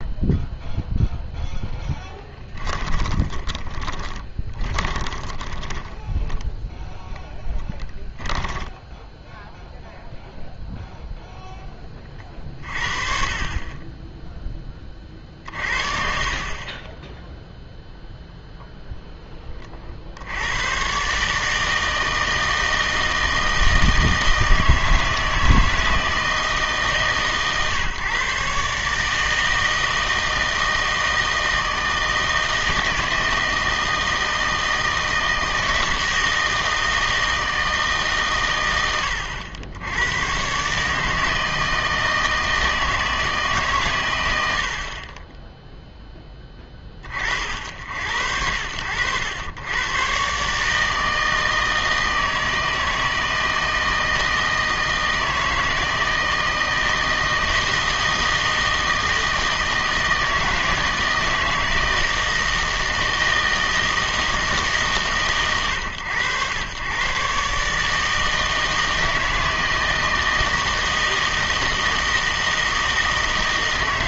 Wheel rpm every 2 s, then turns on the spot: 0, 10, 20, 0, 10, 0, 50, 20, 30, 0, 120, 160, 160, 150, 150, 160, 160, 160, 160, 110, 140, 160, 60, 20, 80, 150, 160, 160, 160, 160, 170, 160, 150, 110, 160, 160, 160.
2-6